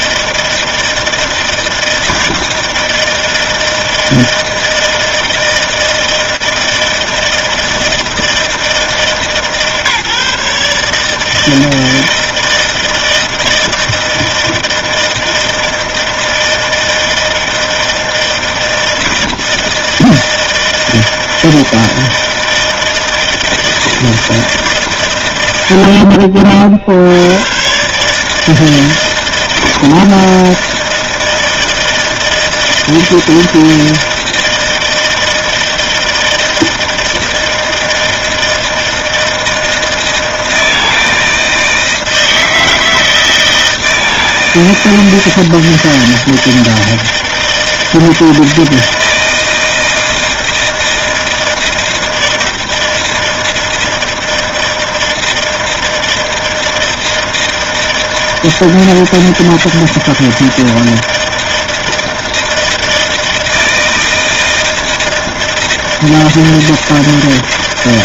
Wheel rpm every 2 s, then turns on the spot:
160, 160, 160, 160, 160, 150, 160, 160, 160, 160, 160, 160, 140, 70, 160, 160, 160, 160, 160, 160, 160, 160, 160, 160, 160, 160, 160, 160, 160, 160, 160, 160, 160, 160.
none